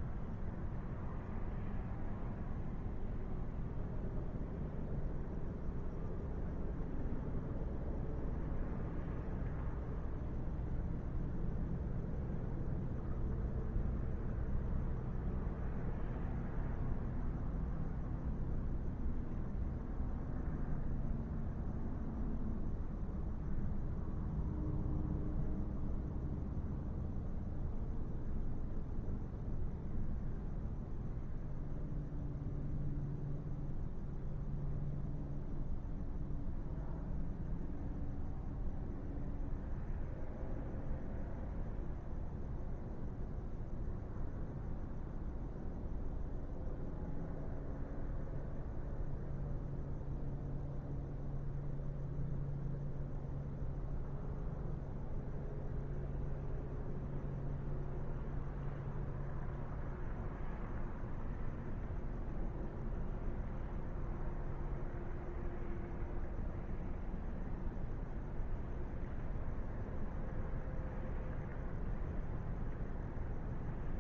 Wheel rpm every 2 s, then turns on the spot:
0, 0, 0, 0, 0, 0, 0, 0, 0, 0, 0, 0, 0, 0, 0, 0, 0, 0, 0, 0, 0, 0, 0, 0, 0, 0, 0, 0, 0, 0, 0, 0, 0, 0, 0, 0, 0.
none